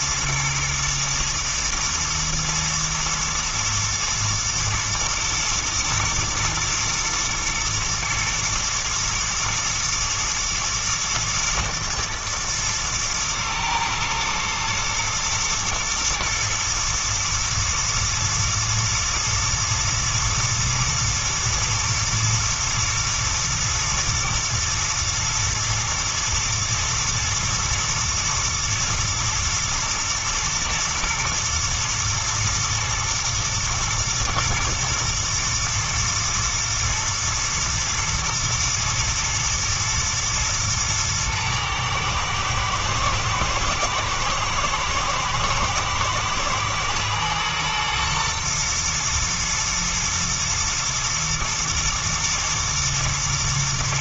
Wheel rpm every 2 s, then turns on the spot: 120, 110, 120, 120, 110, 110, 110, 110, 110, 110, 110, 120, 110, 120, 110, 110, 110, 110, 120, 110, 110, 110, 110, 110, 110, 110, 110.
none